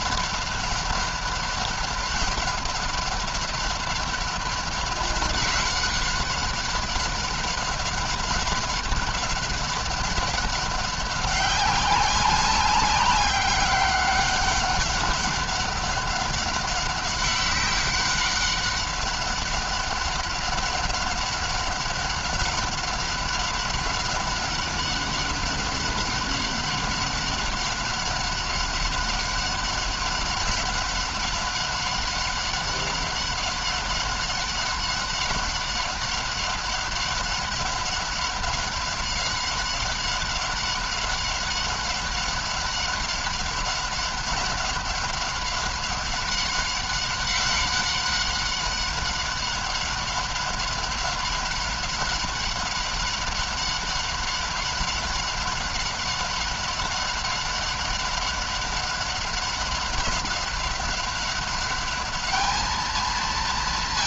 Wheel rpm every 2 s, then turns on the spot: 190, 190, 190, 190, 190, 190, 190, 190, 190, 190, 190, 190, 200, 190, 190, 190, 200, 190, 190, 190, 190, 200, 190, 190, 190, 190, 190, 190, 190, 190, 190, 210.
none